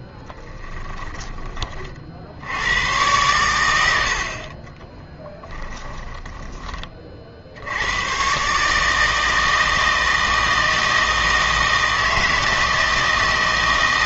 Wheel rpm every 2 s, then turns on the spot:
10, 100, 20, 30, 150, 160, 160.
none